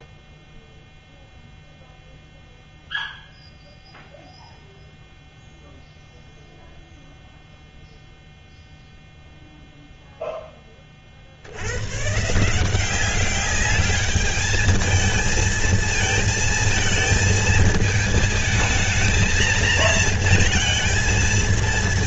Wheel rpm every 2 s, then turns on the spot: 0, 0, 0, 0, 0, 20, 170, 220, 230, 220, 230.
none